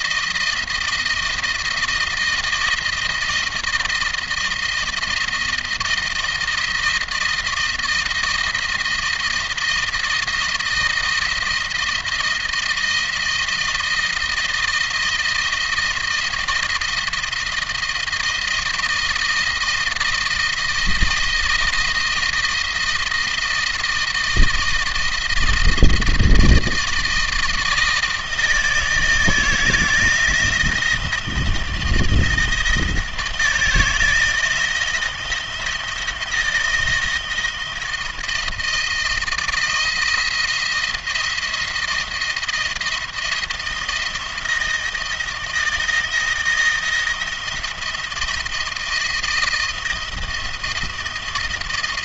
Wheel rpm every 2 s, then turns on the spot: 160, 160, 170, 160, 160, 160, 170, 160, 160, 160, 170, 170, 170, 160, 160, 160, 160, 160, 170, 170, 160, 170, 160, 160, 160, 160.
none